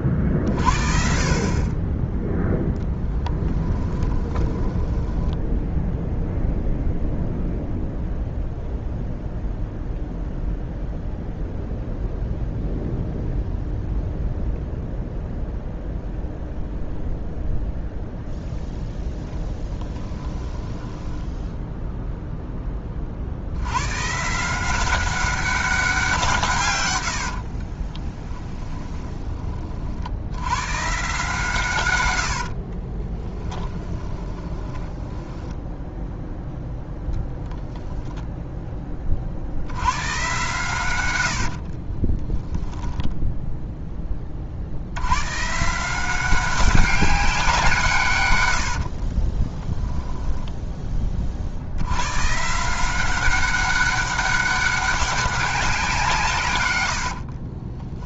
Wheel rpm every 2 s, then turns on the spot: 30, 0, 10, 0, 0, 0, 0, 0, 0, 10, 10, 20, 180, 130, 10, 110, 50, 10, 0, 10, 110, 10, 80, 190, 80, 10, 170, 200, 130.
4-6 20-22 28-30 32-36 48-50 56-58